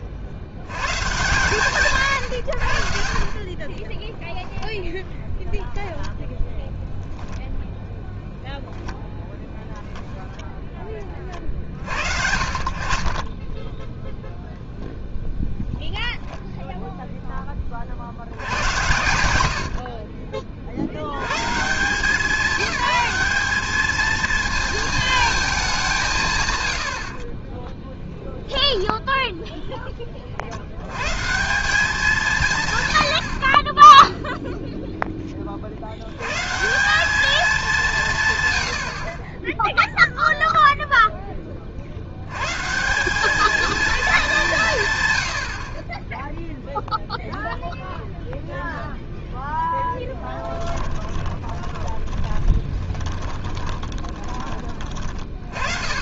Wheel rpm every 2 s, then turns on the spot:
130, 80, 10, 10, 0, 10, 50, 0, 0, 110, 40, 200, 220, 120, 0, 90, 140, 0, 140, 110, 0, 140, 180, 0, 0, 20, 20, 30.
50-54